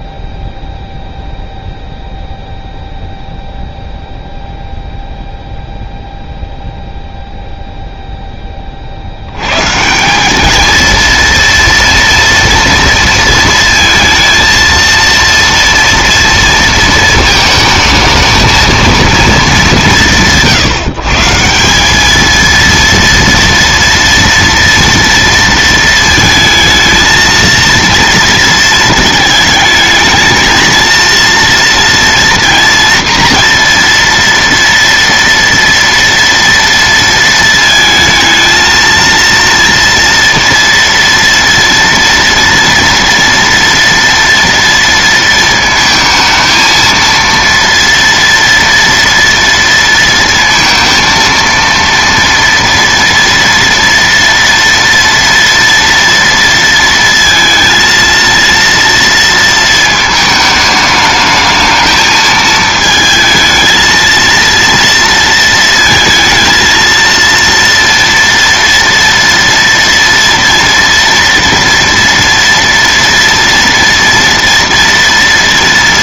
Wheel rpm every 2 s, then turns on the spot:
0, 0, 0, 0, 30, 220, 230, 230, 230, 220, 150, 230, 230, 220, 220, 220, 230, 230, 230, 230, 230, 230, 230, 230, 230, 230, 230, 230, 230, 230, 210, 220, 230, 230, 230, 230, 230, 230.
none